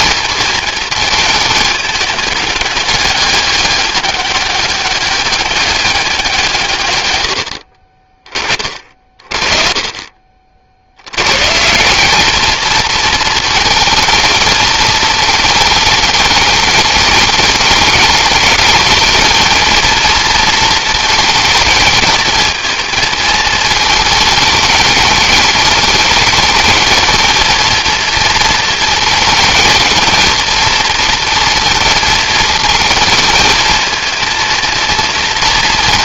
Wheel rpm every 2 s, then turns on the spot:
220, 210, 200, 160, 30, 60, 220, 220, 210, 210, 220, 220, 220, 210, 230, 230, 220, 230.
none